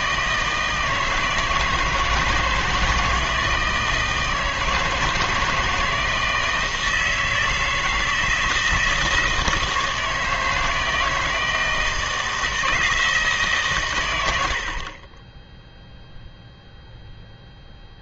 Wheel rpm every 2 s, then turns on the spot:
160, 160, 160, 160, 160, 160, 160, 50, 0.
14-16